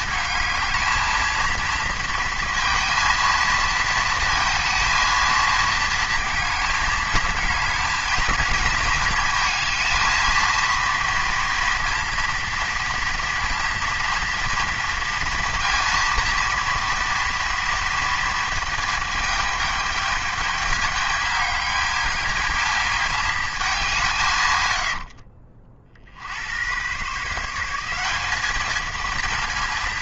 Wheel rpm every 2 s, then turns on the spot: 220, 230, 230, 220, 230, 230, 230, 230, 230, 220, 220, 220, 100, 120, 220.
24-26